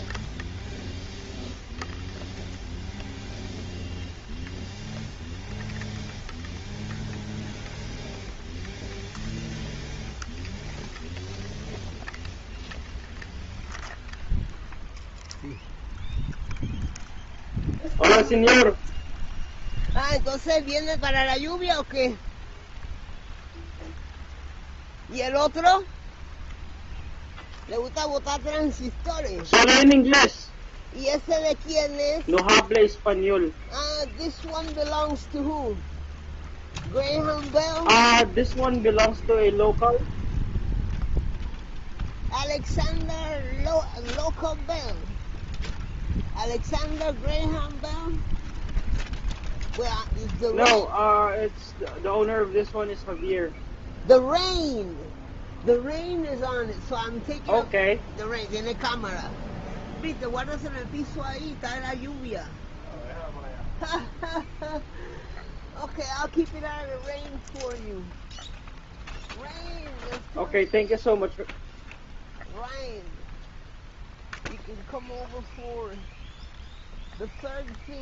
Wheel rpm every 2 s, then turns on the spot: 0, 0, 0, 0, 0, 0, 0, 0, 0, 0, 0, 0, 0, 0, 0, 0, 0, 0, 0, 0, 0, 0, 0, 0, 0, 0, 0, 0, 0, 0, 0, 0, 0, 0, 0, 0, 0, 0, 0.
none